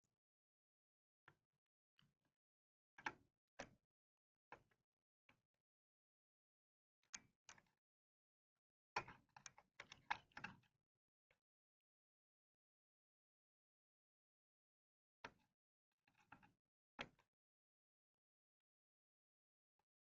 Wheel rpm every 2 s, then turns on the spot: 0, 0, 0, 0, 0, 0, 0, 0, 0, 0.
none